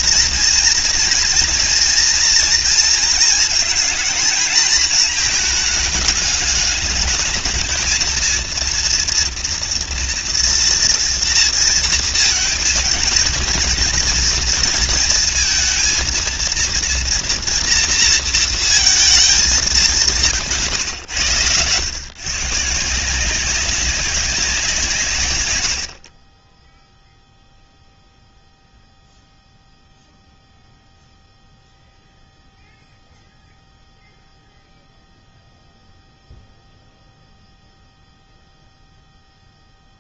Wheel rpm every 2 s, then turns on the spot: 230, 230, 230, 210, 230, 230, 230, 230, 230, 220, 110, 170, 150, 0, 0, 0, 0, 0, 0, 0.
none